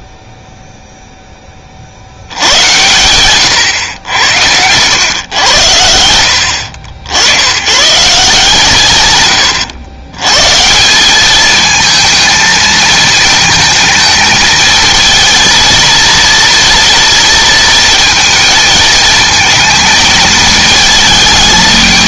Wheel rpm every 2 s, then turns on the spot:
0, 40, 100, 80, 140, 100, 220, 220, 230, 230, 230.
none